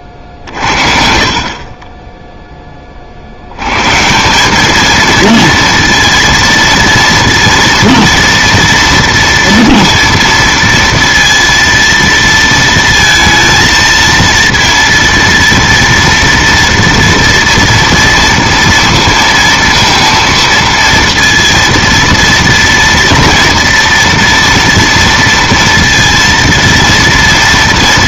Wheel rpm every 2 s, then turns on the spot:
30, 20, 210, 230, 230, 230, 220, 230, 230, 230, 230, 230, 230, 230.
none